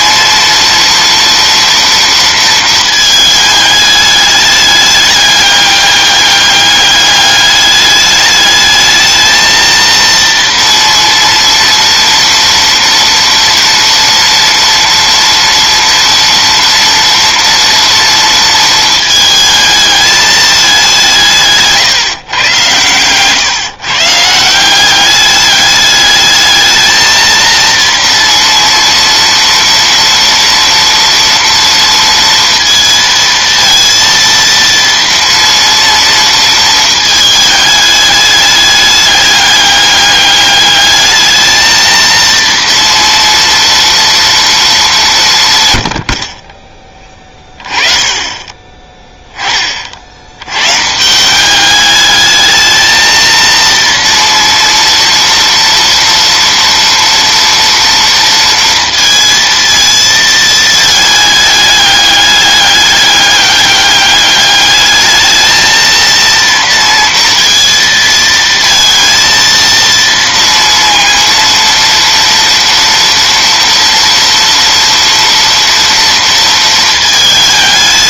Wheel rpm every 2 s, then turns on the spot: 230, 230, 210, 200, 210, 230, 230, 230, 230, 230, 210, 120, 180, 220, 230, 230, 230, 230, 220, 210, 210, 230, 210, 20, 20, 130, 220, 230, 230, 230, 220, 200, 210, 230, 230, 230, 230, 230, 230.
none